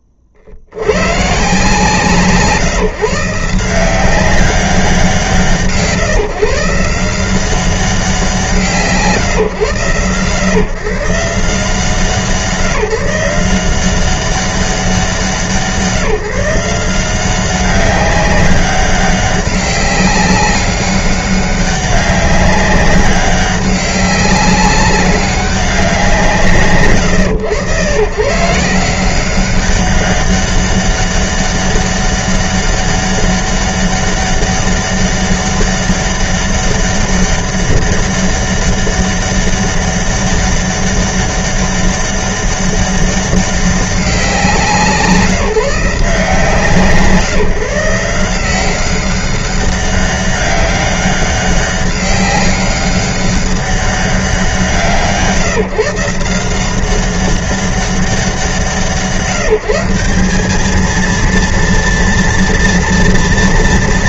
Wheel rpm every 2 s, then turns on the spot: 40, 150, 190, 150, 160, 140, 160, 180, 170, 200, 200, 200, 190, 140, 150, 200, 200, 200, 200, 200, 200, 200, 180, 170, 180, 200, 200, 160, 180, 170, 210, 230.
none